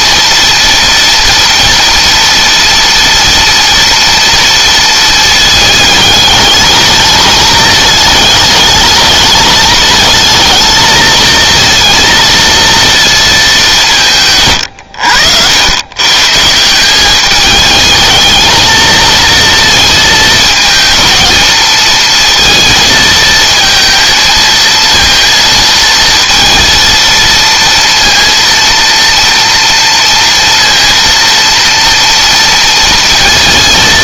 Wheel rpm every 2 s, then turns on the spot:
230, 230, 230, 220, 220, 230, 230, 90, 190, 230, 230, 220, 230, 230, 230, 230, 230.
none